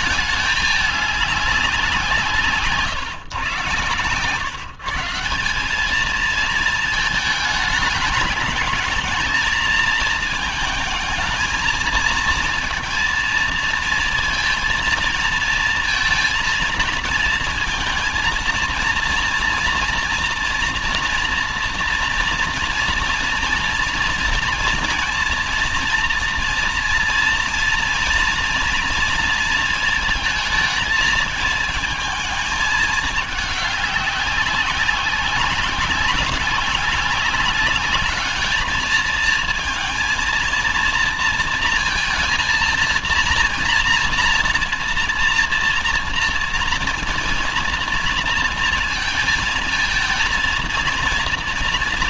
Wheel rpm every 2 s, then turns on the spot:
210, 140, 160, 220, 220, 220, 220, 230, 230, 230, 230, 240, 230, 230, 230, 220, 210, 190, 200, 220, 230, 230, 230, 230, 230, 230.
none